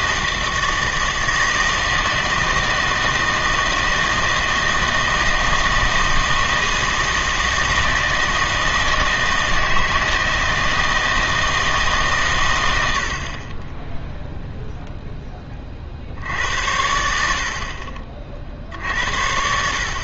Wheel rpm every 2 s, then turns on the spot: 160, 160, 160, 160, 160, 160, 100, 0, 80, 60.
none